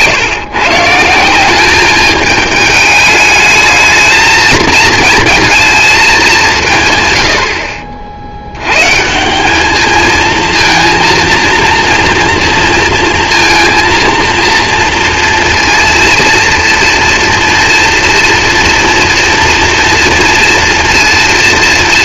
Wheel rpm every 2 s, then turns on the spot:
150, 210, 220, 170, 100, 230, 230, 230, 230, 230, 230.
none